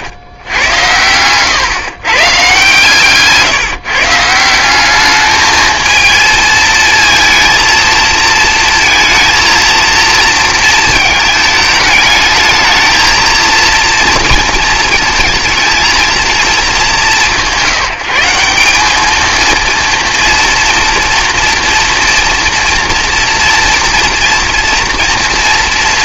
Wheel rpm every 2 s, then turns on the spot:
100, 140, 190, 230, 230, 220, 220, 230, 190, 190, 230, 230, 230.
none